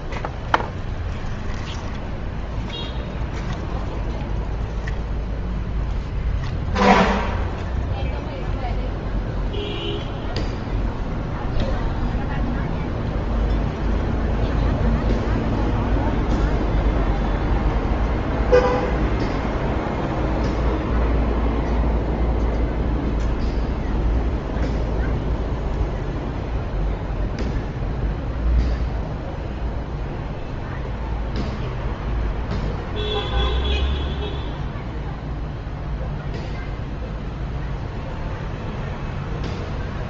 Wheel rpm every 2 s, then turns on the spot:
0, 0, 0, 0, 0, 0, 0, 0, 0, 0, 0, 0, 0, 0, 0, 0, 0, 0, 0, 0.
none